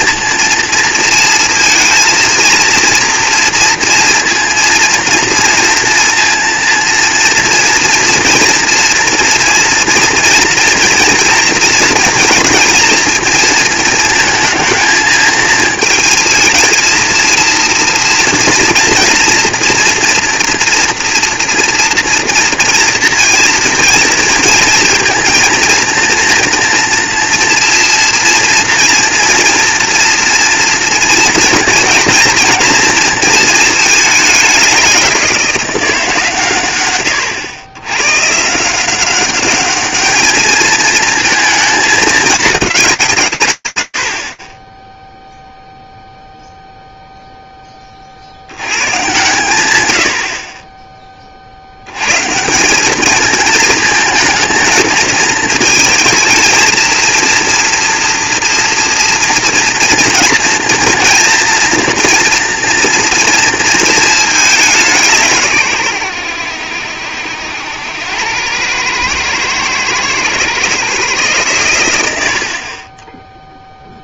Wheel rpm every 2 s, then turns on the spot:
230, 230, 230, 230, 230, 240, 230, 220, 220, 240, 230, 230, 230, 230, 230, 240, 230, 200, 130, 170, 220, 200, 20, 0, 120, 30, 210, 220, 230, 230, 230, 230, 170, 80, 110, 140, 30.
none